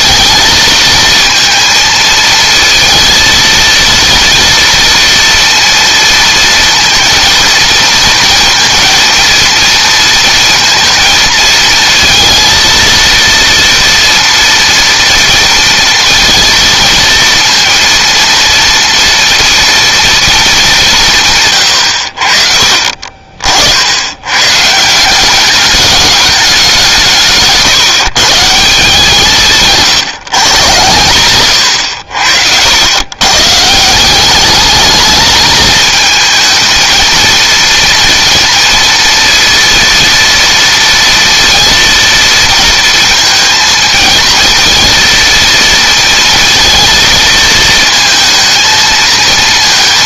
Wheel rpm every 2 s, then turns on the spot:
230, 230, 230, 230, 230, 230, 230, 230, 230, 230, 160, 50, 180, 170, 160, 110, 110, 220, 230, 230, 230, 230, 230, 230, 220.
22-24